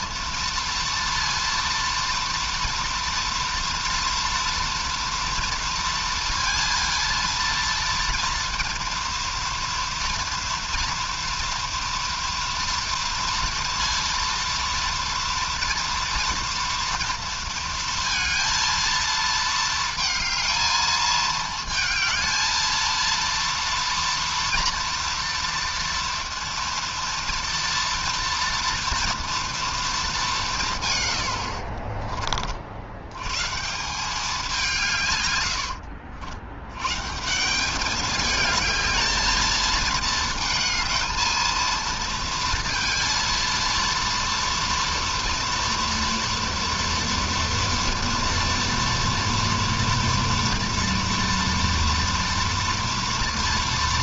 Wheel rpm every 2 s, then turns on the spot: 230, 230, 230, 230, 230, 230, 230, 230, 230, 230, 220, 220, 240, 230, 230, 170, 50, 190, 90, 220, 220, 230, 230, 230, 230, 230, 230.
none